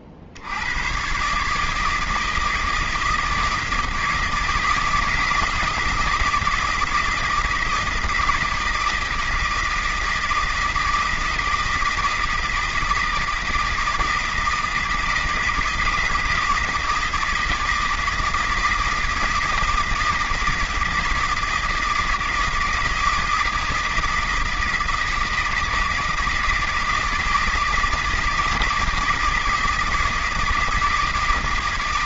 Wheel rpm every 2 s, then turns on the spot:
80, 160, 160, 160, 160, 160, 160, 160, 160, 160, 160, 160, 160, 160, 160, 160.
none